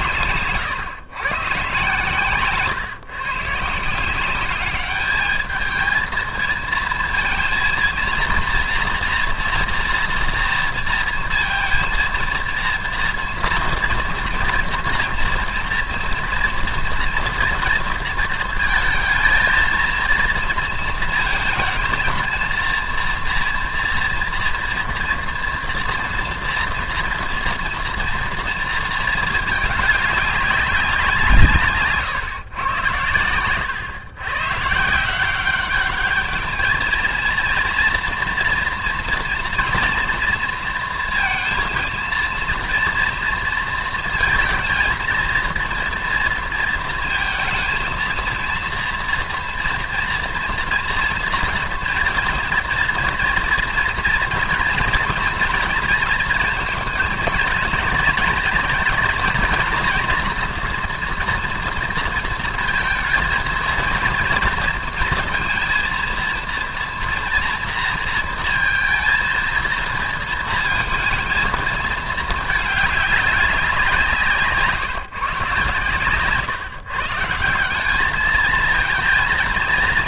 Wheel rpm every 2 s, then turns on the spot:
120, 130, 210, 220, 230, 230, 230, 240, 230, 220, 230, 230, 230, 230, 220, 180, 110, 150, 220, 230, 230, 230, 230, 220, 230, 240, 230, 230, 230, 230, 230, 230, 230, 230, 230, 230, 210, 150, 140, 220.
none